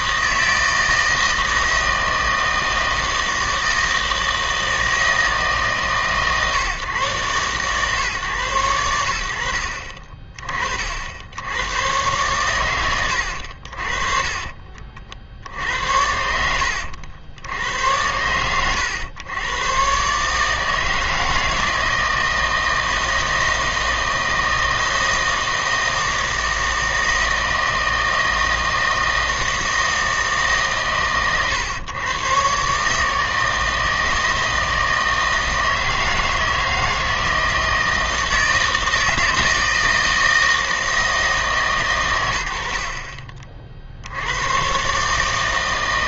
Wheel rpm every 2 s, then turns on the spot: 160, 160, 160, 140, 90, 40, 110, 40, 80, 100, 160, 160, 160, 160, 160, 140, 150, 160, 160, 160, 160, 60, 130.
14-16